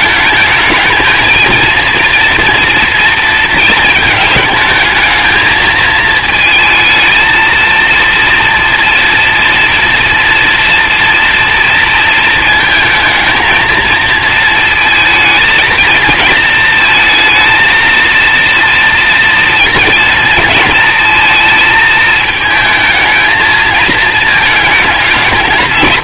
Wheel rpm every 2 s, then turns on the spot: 220, 230, 220, 220, 230, 230, 220, 230, 230, 230, 230, 220, 210.
none